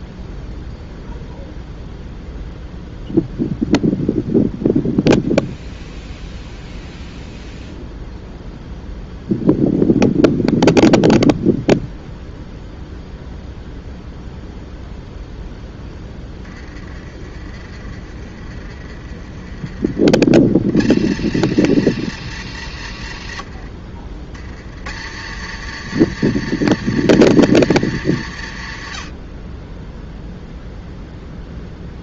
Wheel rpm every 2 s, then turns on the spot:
0, 0, 0, 0, 0, 0, 0, 0, 20, 30, 70, 100, 70, 120, 60, 0.
none